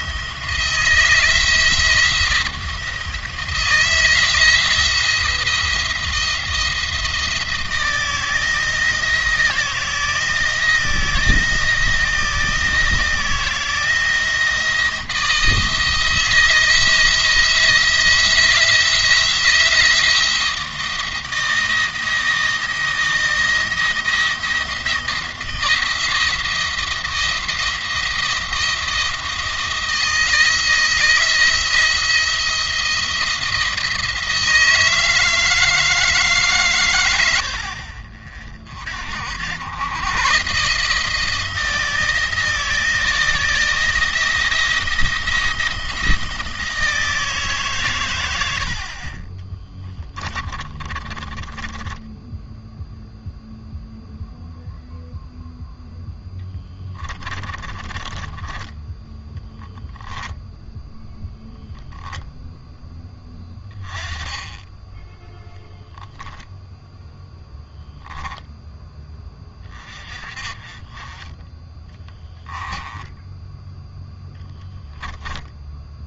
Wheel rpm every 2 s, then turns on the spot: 170, 170, 160, 170, 160, 160, 160, 160, 160, 170, 170, 170, 170, 170, 170, 170, 170, 160, 130, 50, 150, 160, 170, 160, 50, 30, 0, 0, 20, 10, 0, 10, 10, 0, 10, 30, 10, 10.
50-52 56-58 72-76